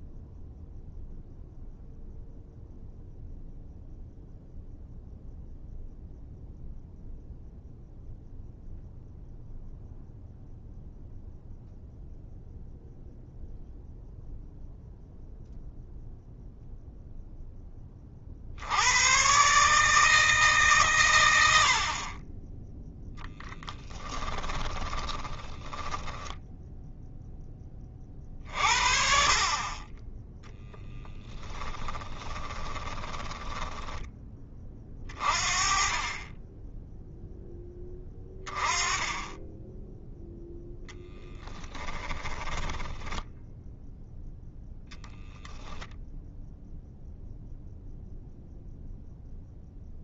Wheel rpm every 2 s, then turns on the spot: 0, 0, 0, 0, 0, 0, 0, 0, 0, 60, 140, 10, 20, 10, 50, 10, 20, 20, 20, 20, 0, 10, 0, 0, 0.
24-28 32-34 42-44